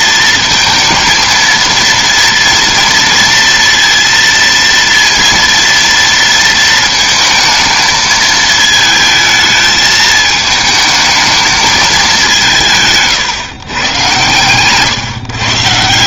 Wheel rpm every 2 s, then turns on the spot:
230, 230, 230, 230, 220, 220, 180, 140.
none